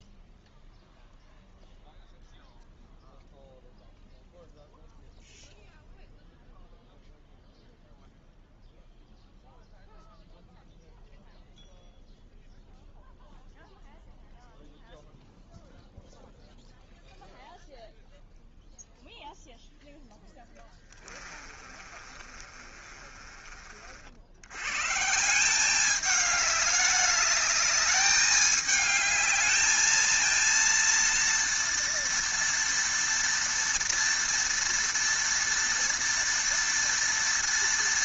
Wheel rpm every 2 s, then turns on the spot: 0, 0, 0, 0, 0, 0, 0, 0, 0, 0, 20, 30, 120, 210, 210, 230, 230, 230, 230.
20-24